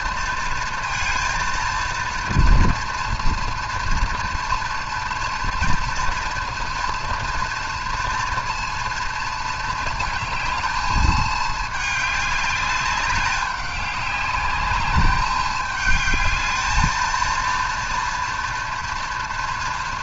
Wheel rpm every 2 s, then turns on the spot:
230, 230, 230, 230, 240, 220, 200, 200, 220, 230.
none